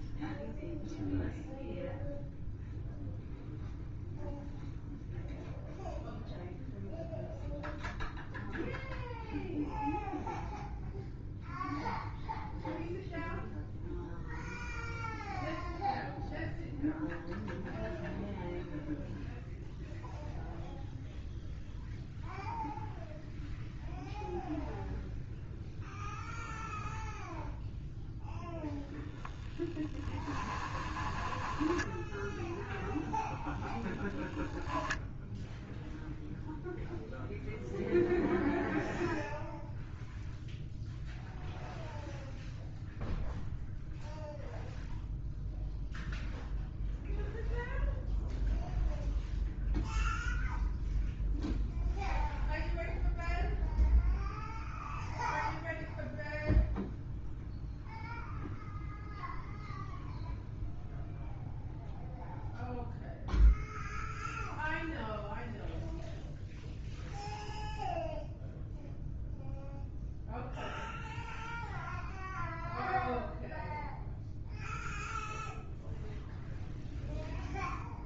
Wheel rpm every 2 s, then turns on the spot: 0, 0, 0, 0, 0, 0, 0, 0, 0, 0, 0, 0, 0, 0, 0, 10, 0, 0, 0, 0, 0, 0, 0, 0, 0, 0, 0, 0, 0, 0, 0, 0, 0, 0, 0, 0, 0, 0, 0.
30-32